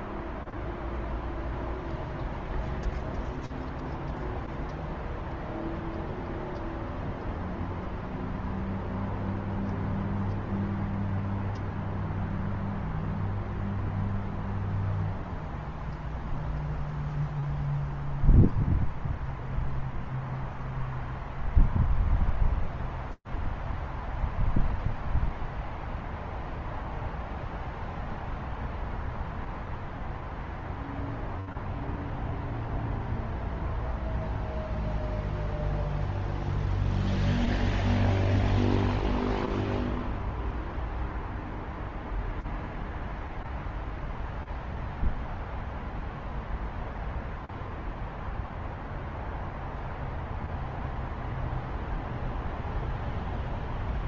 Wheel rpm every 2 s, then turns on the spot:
0, 0, 0, 0, 0, 0, 0, 0, 0, 0, 0, 0, 0, 0, 0, 0, 0, 0, 0, 0, 0, 0, 0, 0, 0, 0, 0.
none